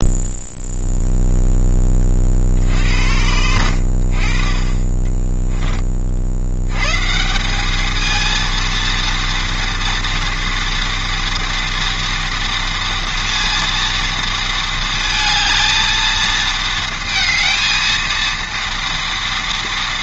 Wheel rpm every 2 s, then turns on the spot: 0, 80, 10, 170, 230, 230, 230, 220, 230, 230.
4-6